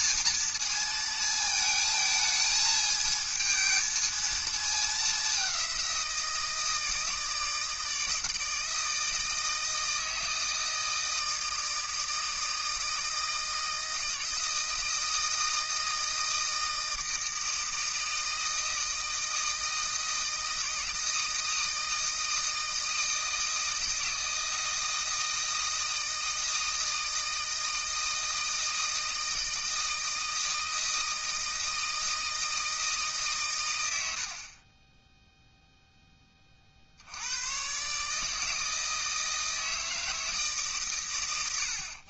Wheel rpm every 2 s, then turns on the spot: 220, 220, 200, 160, 160, 160, 160, 160, 160, 160, 160, 160, 160, 160, 160, 160, 160, 30, 50, 160, 140.
34-36